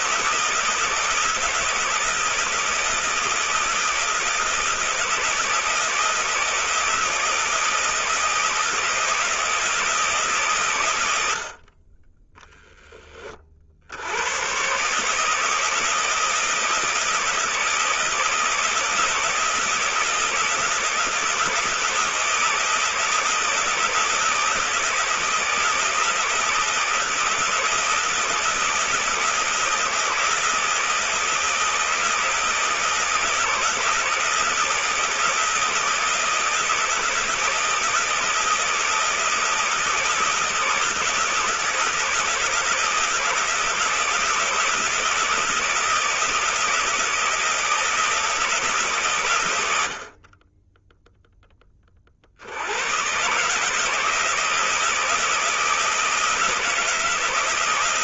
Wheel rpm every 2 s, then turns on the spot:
160, 160, 160, 160, 160, 120, 10, 120, 160, 160, 160, 160, 160, 160, 160, 160, 160, 170, 170, 160, 170, 160, 160, 160, 160, 20, 90, 160, 160.
none